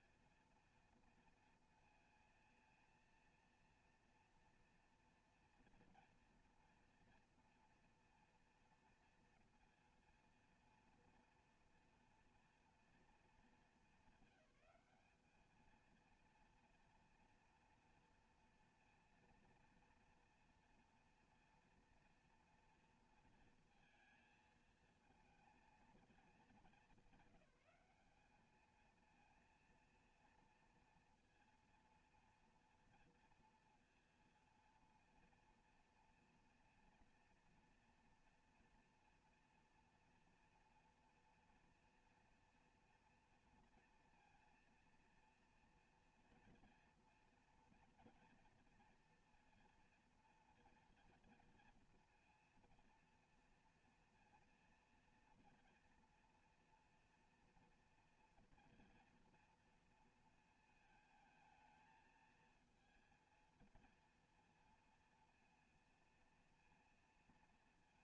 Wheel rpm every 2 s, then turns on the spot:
230, 230, 230, 240, 230, 230, 230, 200, 230, 230, 230, 240, 220, 210, 210, 230, 230, 230, 230, 230, 230, 230, 230, 230, 230, 230, 230, 230, 240, 240, 230, 220, 230, 230.
none